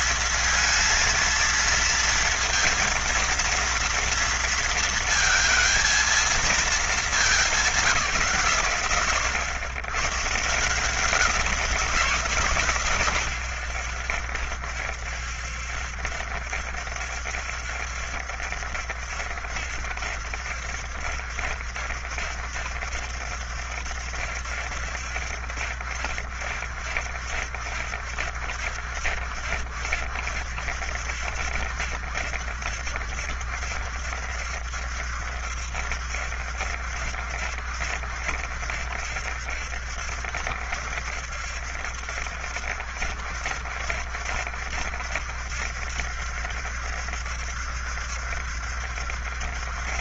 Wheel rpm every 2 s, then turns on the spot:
220, 230, 230, 220, 100, 160, 130, 70, 70, 70, 70, 70, 70, 70, 70, 70, 70, 70, 70, 70, 70, 70, 70, 70, 70.
none